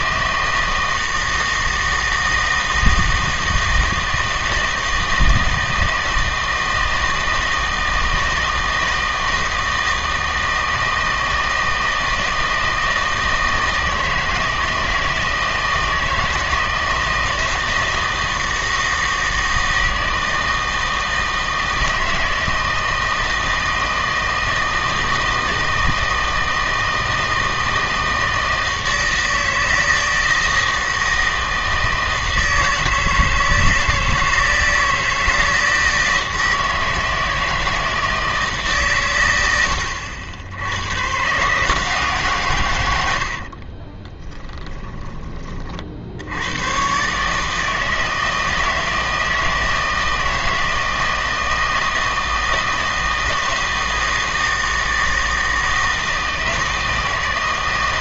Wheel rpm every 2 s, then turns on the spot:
160, 160, 160, 160, 160, 160, 160, 170, 160, 160, 160, 160, 160, 160, 160, 160, 160, 160, 160, 150, 90, 120, 10, 100, 160, 160, 160, 160, 160.
44-46